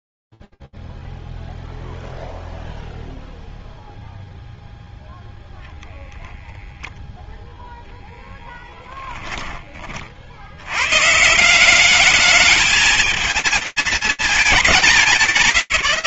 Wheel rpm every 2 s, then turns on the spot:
0, 0, 0, 0, 10, 120, 220, 130.
8-10